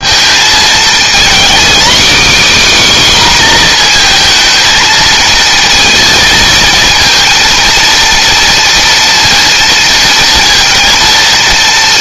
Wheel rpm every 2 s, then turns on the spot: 230, 270, 220, 230, 230, 230.
none